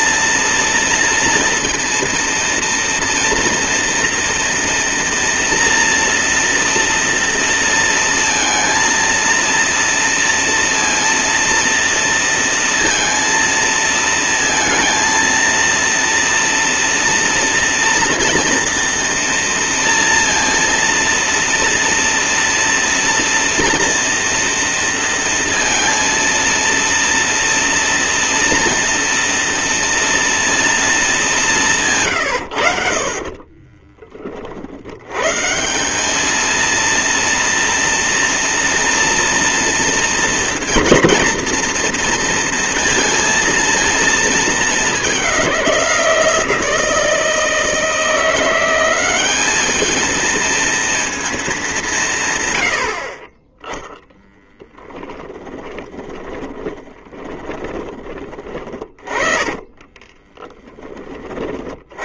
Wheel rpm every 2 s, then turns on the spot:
230, 230, 230, 230, 230, 230, 230, 230, 230, 230, 230, 240, 230, 230, 230, 230, 60, 70, 230, 240, 230, 230, 210, 160, 190, 230, 70, 10, 20, 40, 10.
54-60